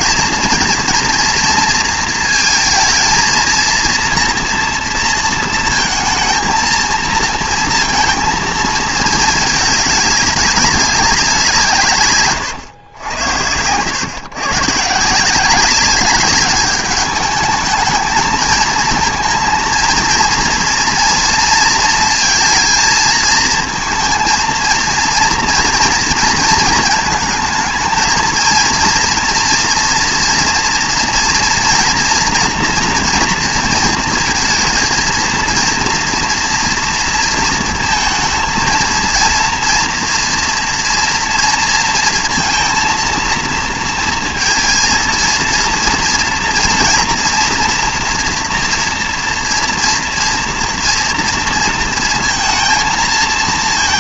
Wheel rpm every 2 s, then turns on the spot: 230, 230, 230, 230, 230, 200, 120, 140, 200, 220, 230, 230, 230, 220, 230, 230, 240, 230, 230, 220, 230, 230, 230, 240, 240, 240, 230.
none